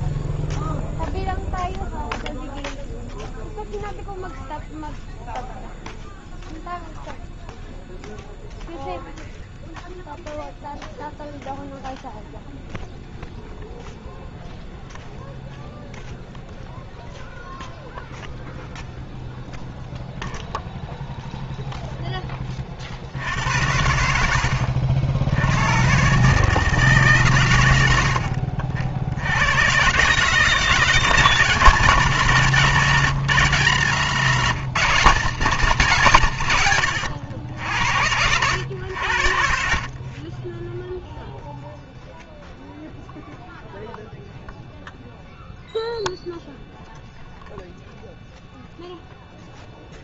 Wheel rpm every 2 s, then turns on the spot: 0, 0, 0, 0, 0, 0, 0, 0, 0, 0, 0, 10, 80, 160, 60, 150, 180, 190, 130, 90, 20, 0, 0, 0, 0.
none